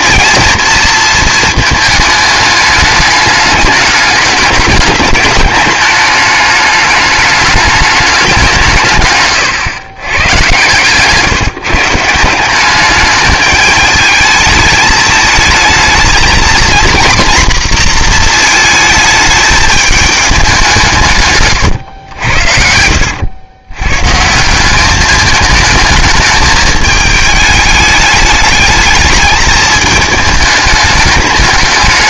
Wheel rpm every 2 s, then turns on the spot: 230, 210, 210, 210, 170, 120, 190, 210, 230, 220, 190, 70, 190, 220, 220, 210.
10-12